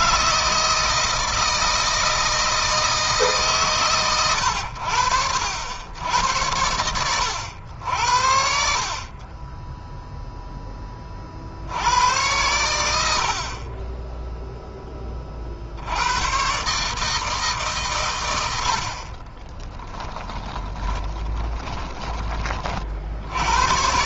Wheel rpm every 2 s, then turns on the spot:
160, 160, 80, 100, 40, 20, 80, 10, 140, 80, 20, 50.
18-22